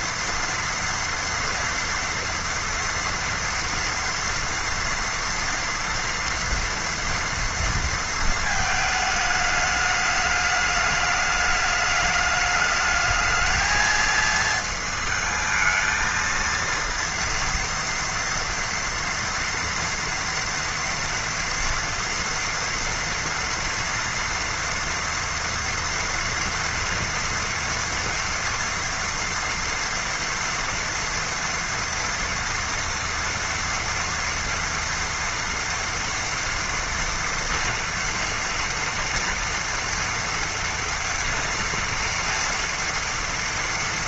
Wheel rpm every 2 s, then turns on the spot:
230, 230, 230, 230, 220, 210, 210, 230, 230, 230, 230, 230, 230, 230, 230, 230, 230, 240, 230, 230, 230, 230.
none